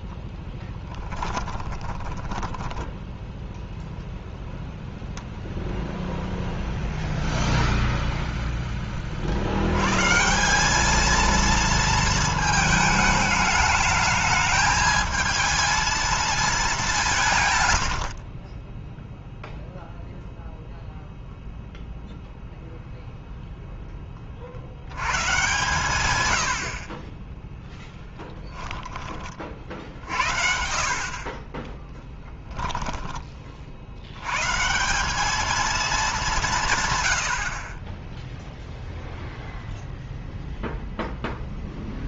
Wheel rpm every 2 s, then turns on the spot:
10, 10, 0, 0, 10, 180, 220, 220, 200, 10, 0, 0, 60, 80, 10, 60, 10, 120, 180, 0, 0.
0-4